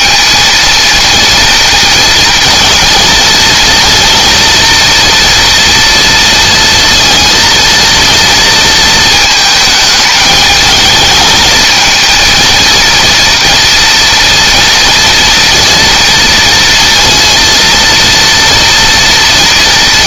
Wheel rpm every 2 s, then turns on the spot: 230, 230, 240, 230, 230, 220, 230, 230, 230, 230.
none